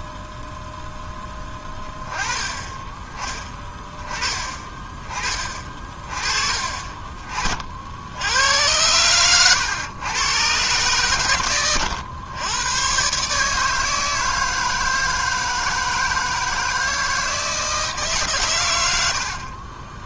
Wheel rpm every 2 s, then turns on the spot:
0, 10, 30, 40, 90, 120, 120, 160, 160, 100.
6-8